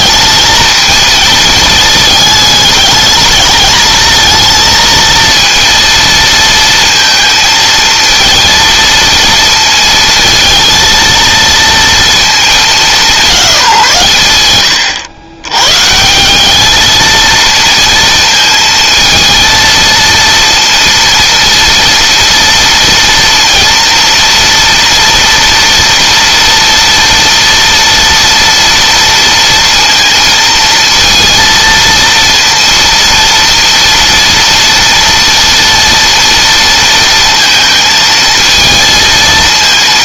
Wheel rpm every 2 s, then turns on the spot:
220, 210, 230, 230, 230, 230, 200, 110, 220, 230, 230, 230, 240, 230, 230, 230, 230, 230, 230, 220.
none